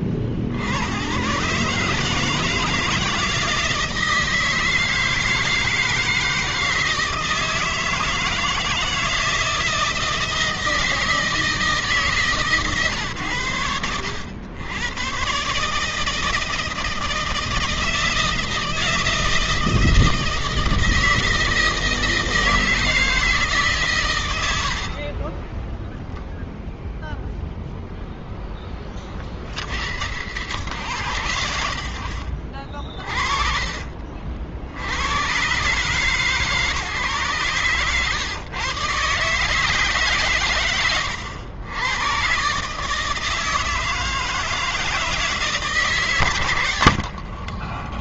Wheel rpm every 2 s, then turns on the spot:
90, 160, 160, 160, 160, 160, 130, 100, 160, 160, 160, 160, 80, 0, 0, 110, 70, 70, 140, 120, 130, 140, 160, 100.
24-26 32-34